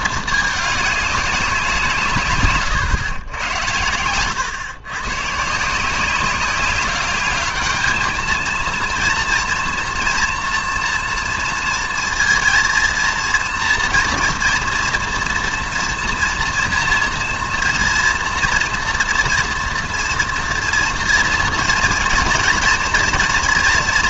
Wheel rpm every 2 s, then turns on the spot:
210, 140, 120, 190, 230, 230, 230, 230, 230, 230, 230, 230.
2-4